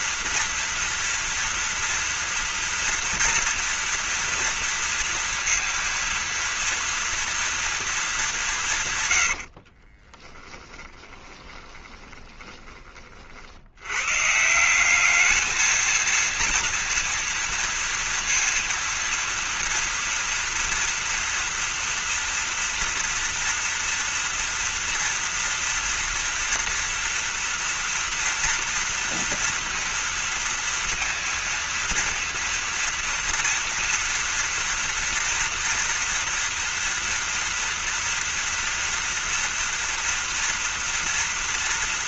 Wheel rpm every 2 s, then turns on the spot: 230, 230, 230, 230, 180, 30, 20, 170, 230, 230, 240, 230, 240, 240, 230, 230, 230, 230, 230, 230, 230.
10-12